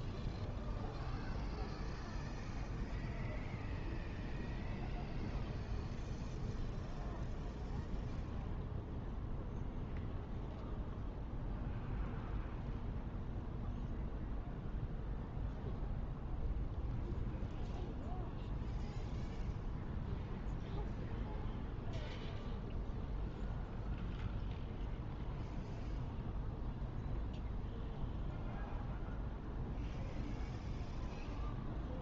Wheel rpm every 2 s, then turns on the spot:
0, 0, 0, 0, 0, 0, 0, 0, 0, 0, 0, 0, 0, 0, 0, 0.
none